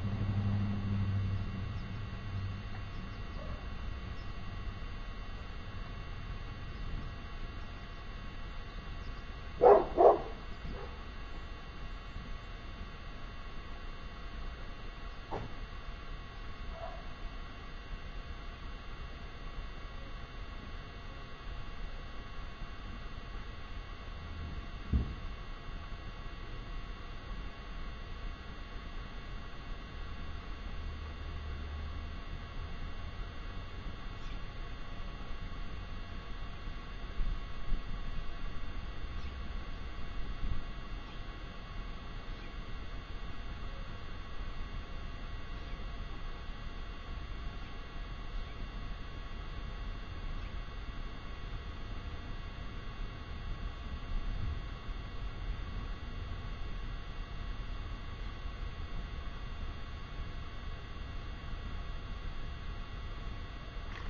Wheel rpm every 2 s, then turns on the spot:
0, 0, 0, 0, 0, 0, 0, 0, 0, 0, 0, 0, 0, 0, 0, 0, 0, 0, 0, 0, 0, 0, 0, 0, 0, 0, 0, 0, 0, 0, 0, 0.
none